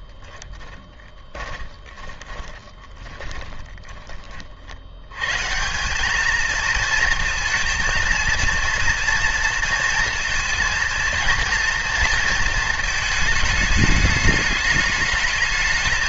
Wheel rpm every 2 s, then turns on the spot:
0, 30, 30, 210, 230, 230, 230, 210.
2-4